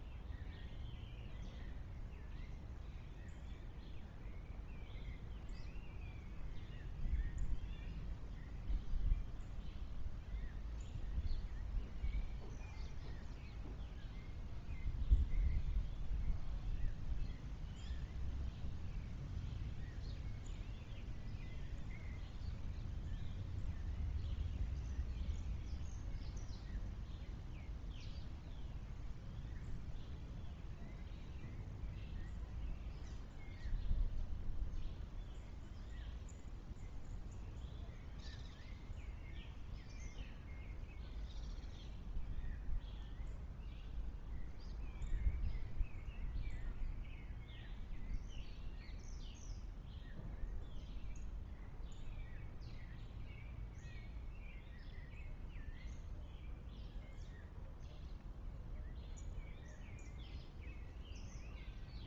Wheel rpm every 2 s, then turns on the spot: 0, 0, 0, 0, 0, 0, 0, 0, 0, 0, 0, 0, 0, 0, 0, 0, 0, 0, 0, 0, 0, 0, 0, 0, 0, 0, 0, 0, 0, 0, 0.
none